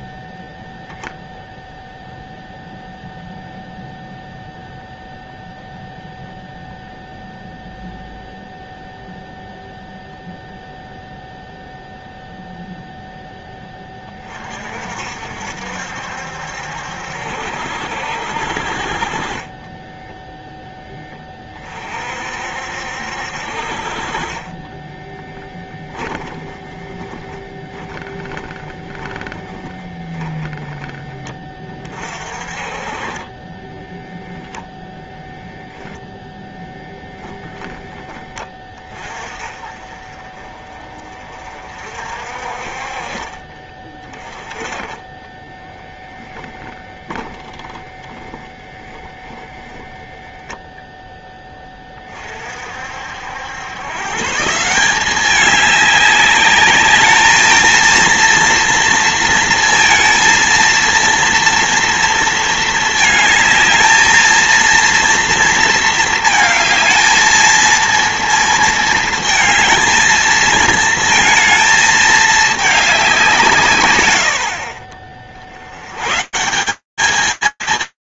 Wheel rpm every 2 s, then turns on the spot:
10, 0, 0, 0, 0, 0, 0, 30, 70, 60, 10, 50, 40, 10, 10, 10, 40, 10, 10, 20, 30, 50, 20, 0, 20, 10, 50, 140, 210, 230, 230, 230, 220, 230, 230, 220, 210, 90, 150.
24-30 34-38 48-50